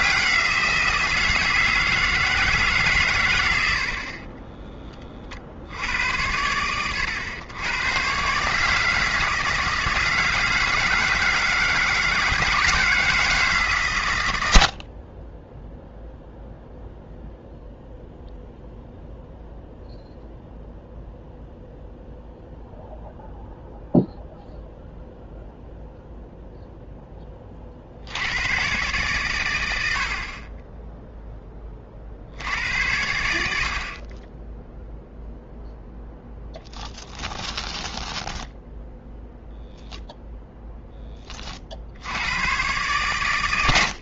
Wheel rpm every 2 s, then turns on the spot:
140, 10, 100, 150, 160, 160, 90, 0, 0, 0, 0, 0, 0, 30, 110, 10, 80, 0, 10, 0, 10, 120.
36-38